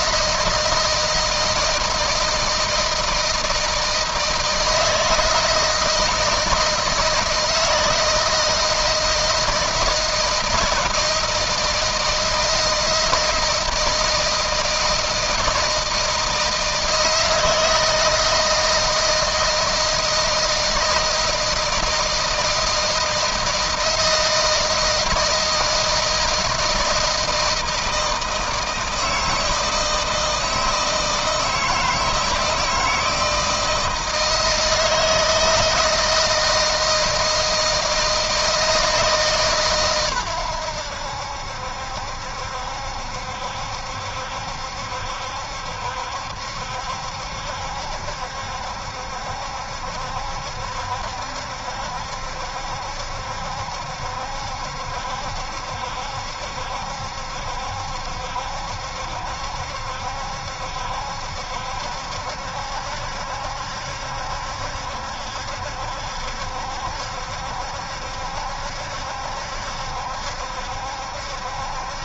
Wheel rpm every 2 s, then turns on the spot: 160, 160, 160, 160, 160, 160, 160, 160, 160, 160, 160, 160, 160, 160, 160, 160, 160, 160, 160, 160, 90, 70, 70, 70, 70, 70, 70, 70, 70, 70, 70, 70, 70, 70, 70, 70.
none